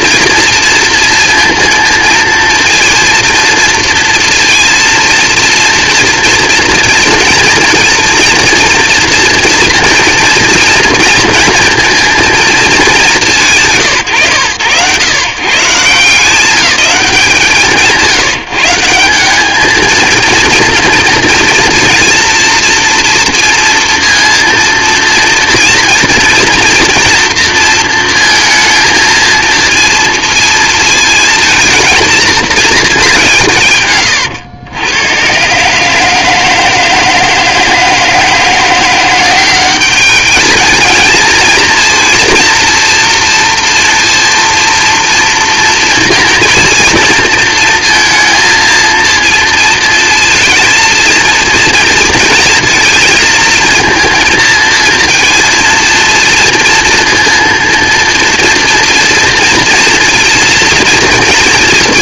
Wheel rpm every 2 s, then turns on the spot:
230, 230, 230, 230, 230, 230, 220, 110, 190, 150, 230, 230, 230, 230, 230, 230, 220, 100, 160, 170, 210, 230, 230, 230, 230, 230, 230, 230, 230, 230, 230.
none